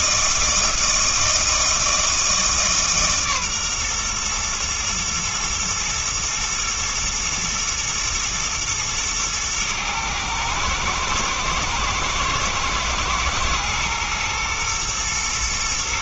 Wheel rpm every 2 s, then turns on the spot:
160, 150, 120, 120, 110, 110, 110, 120.
none